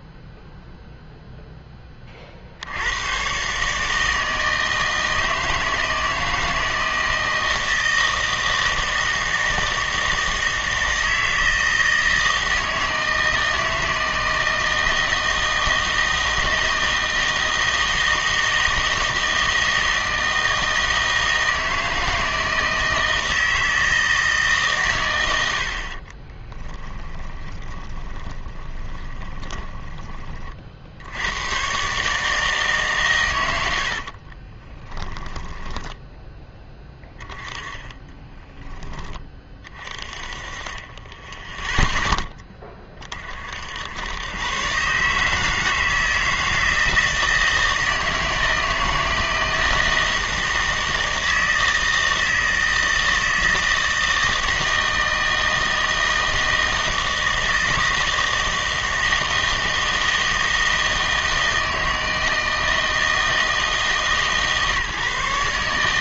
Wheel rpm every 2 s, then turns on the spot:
0, 80, 160, 160, 160, 160, 160, 160, 160, 160, 160, 160, 130, 10, 20, 40, 140, 20, 10, 10, 20, 30, 130, 160, 160, 170, 160, 160, 160, 160, 160, 160, 140.
26-30 34-36